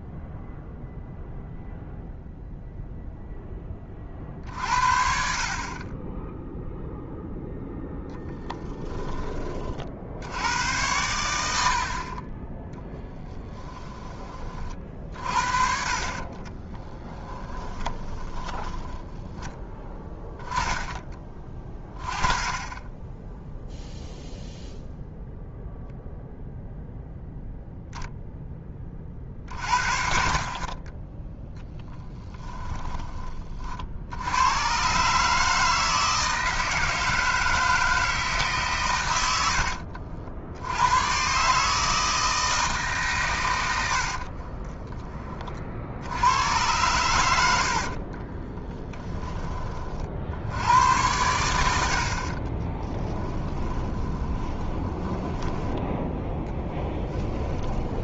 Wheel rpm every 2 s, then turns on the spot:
0, 0, 50, 0, 10, 100, 10, 40, 20, 20, 10, 20, 0, 0, 20, 30, 10, 130, 160, 140, 90, 150, 50, 100, 10, 100, 20, 20, 10.
16-20 52-58